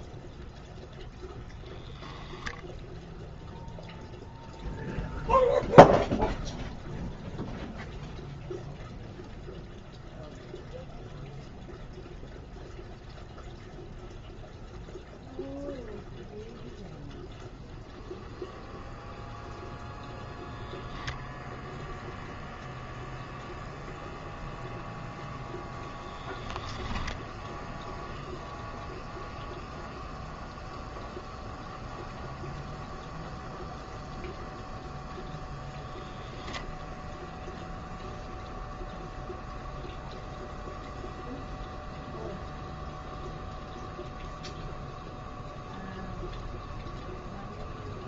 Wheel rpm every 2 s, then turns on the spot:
0, 0, 0, 0, 0, 0, 0, 0, 0, 0, 0, 0, 0, 10, 0, 0, 0, 0, 0, 0, 0, 0, 0, 0.
26-28